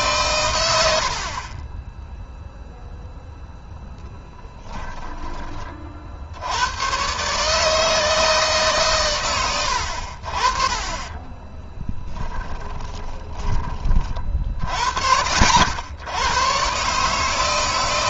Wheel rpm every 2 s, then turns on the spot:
80, 0, 20, 120, 140, 20, 20, 50, 140.
10-14